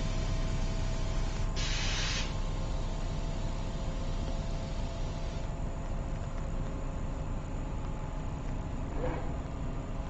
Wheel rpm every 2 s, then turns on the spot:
0, 0, 0, 0, 0.
none